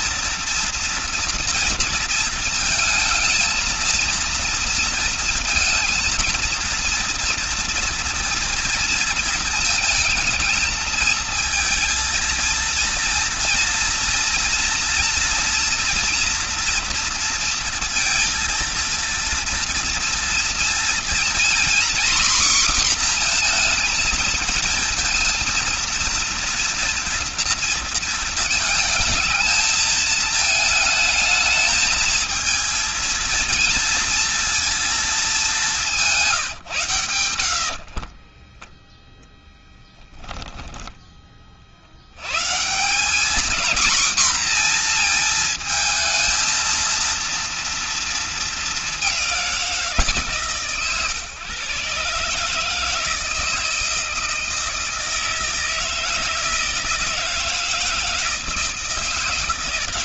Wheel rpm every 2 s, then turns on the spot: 230, 220, 230, 230, 230, 220, 230, 230, 230, 230, 230, 250, 220, 230, 220, 220, 230, 230, 130, 10, 10, 140, 240, 230, 210, 130, 150, 160, 160, 160.
38-40